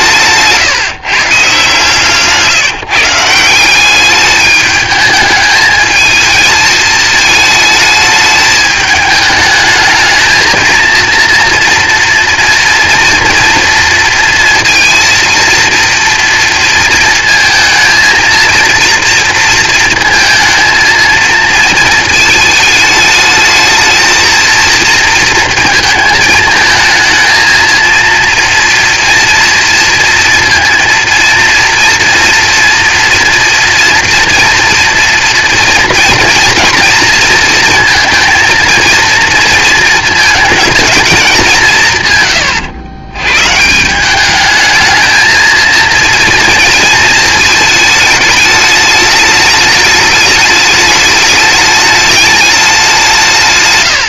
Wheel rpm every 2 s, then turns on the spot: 150, 160, 210, 220, 210, 220, 230, 230, 230, 230, 230, 220, 230, 220, 230, 230, 230, 230, 230, 220, 220, 110, 220, 230, 210, 210, 190.
none